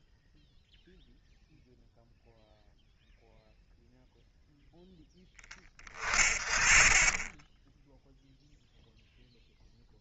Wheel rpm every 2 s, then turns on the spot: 0, 0, 40, 0, 30.
none